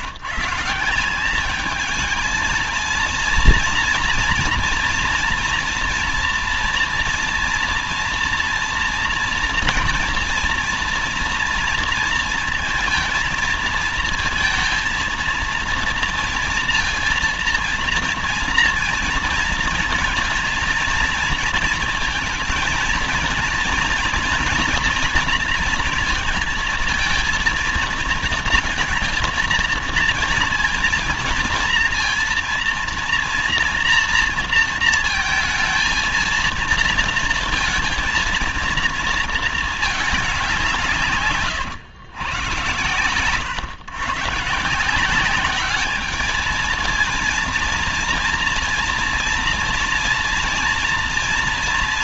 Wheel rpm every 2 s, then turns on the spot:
160, 230, 240, 230, 240, 230, 230, 230, 230, 230, 230, 230, 230, 220, 230, 230, 230, 230, 230, 230, 180, 110, 150, 220, 230, 230.
none